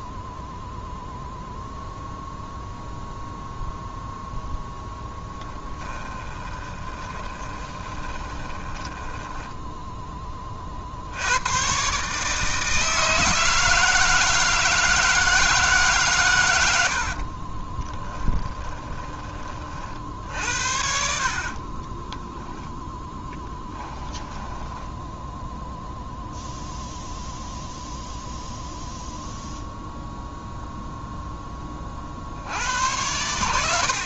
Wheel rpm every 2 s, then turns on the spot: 0, 0, 0, 20, 10, 60, 160, 160, 70, 20, 60, 10, 10, 0, 0, 0, 90.
6-10 18-20 22-26